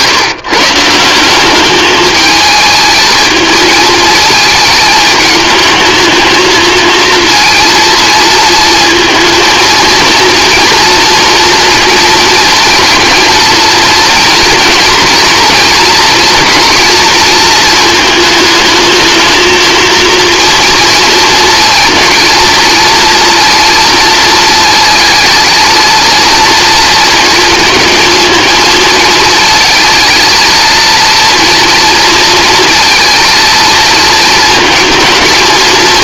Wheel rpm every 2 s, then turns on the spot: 150, 220, 220, 230, 230, 230, 230, 230, 230, 220, 230, 230, 230, 230, 230, 230, 230, 230.
none